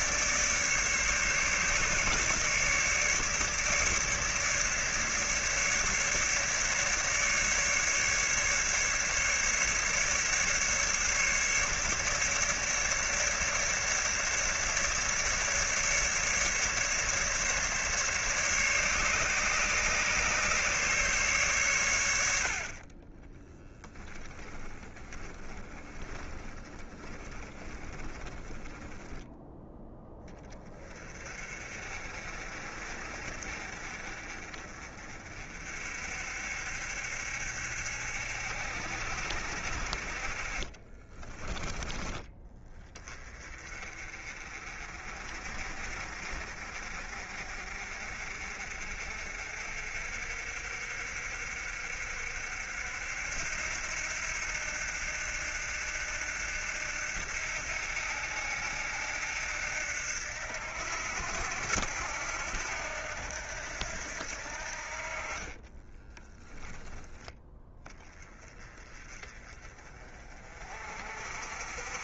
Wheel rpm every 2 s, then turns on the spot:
150, 150, 150, 150, 150, 150, 150, 150, 140, 140, 140, 30, 20, 20, 10, 30, 50, 50, 70, 70, 30, 20, 40, 50, 60, 60, 70, 80, 80, 80, 80, 80, 40, 10, 30, 50.
22-28 40-42